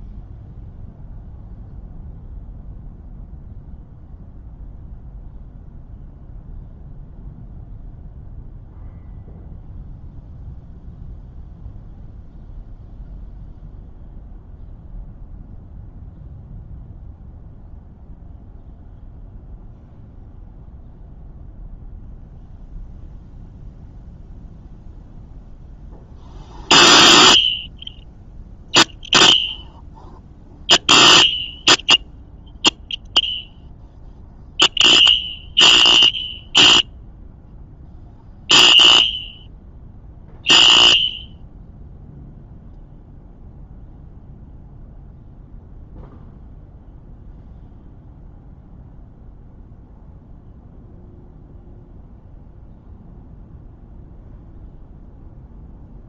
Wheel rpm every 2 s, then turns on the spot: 0, 0, 0, 0, 0, 0, 0, 0, 0, 0, 0, 0, 0, 0, 0, 0, 0, 0, 0, 0, 0, 0, 0, 0, 0, 0, 0, 0.
none